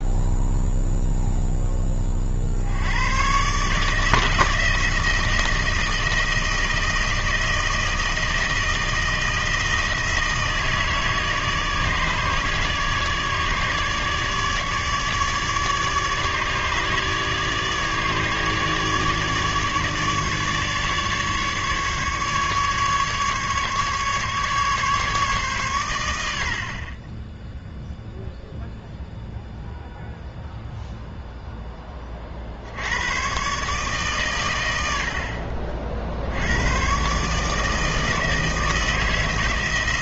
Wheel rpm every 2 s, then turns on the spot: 0, 90, 160, 160, 160, 160, 150, 150, 150, 150, 150, 150, 150, 50, 0, 0, 90, 80, 120, 160.
none